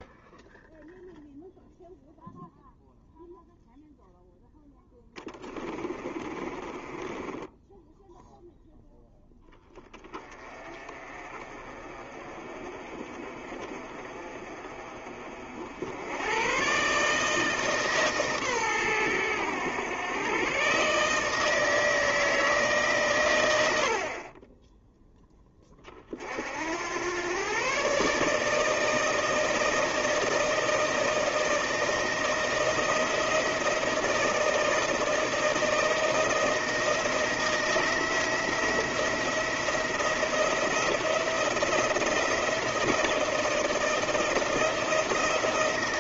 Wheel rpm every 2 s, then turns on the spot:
0, 0, 10, 20, 0, 30, 30, 40, 140, 120, 140, 140, 10, 90, 160, 160, 160, 160, 160, 170, 170, 170, 170.
4-8